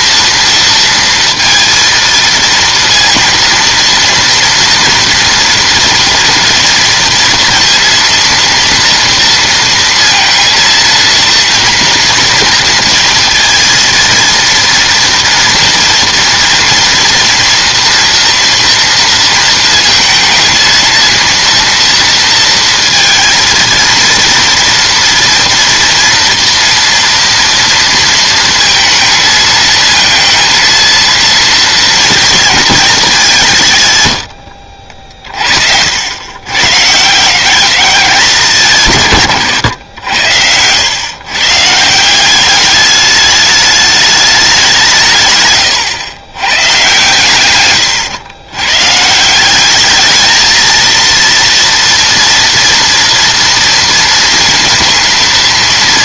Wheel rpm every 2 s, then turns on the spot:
230, 230, 230, 230, 230, 230, 230, 240, 230, 230, 230, 230, 230, 230, 230, 230, 220, 60, 130, 150, 90, 200, 190, 120, 130, 230, 230, 230.
none